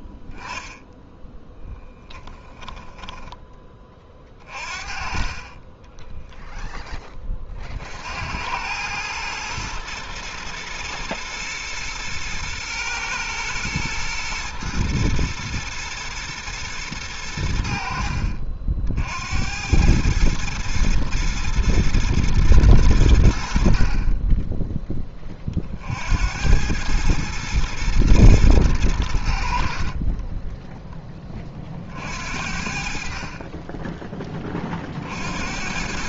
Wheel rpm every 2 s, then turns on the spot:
0, 10, 30, 0, 100, 120, 120, 120, 110, 60, 110, 110, 10, 100, 110, 10, 60, 30.
2-4